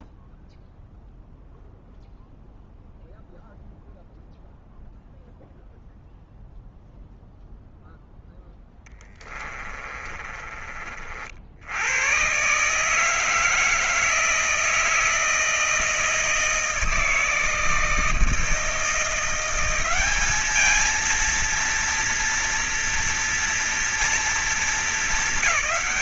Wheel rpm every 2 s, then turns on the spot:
0, 0, 0, 0, 0, 30, 110, 160, 160, 160, 200, 240, 220.
none